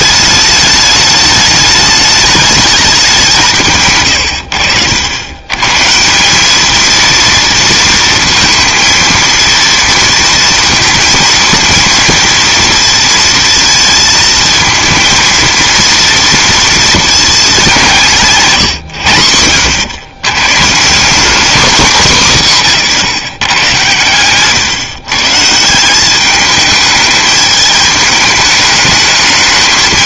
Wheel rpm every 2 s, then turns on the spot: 210, 200, 80, 220, 230, 230, 230, 220, 230, 130, 170, 170, 140, 210, 210.
none